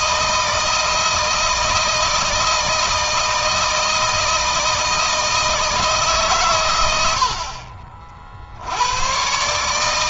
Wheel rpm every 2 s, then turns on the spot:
160, 160, 160, 110, 100.
none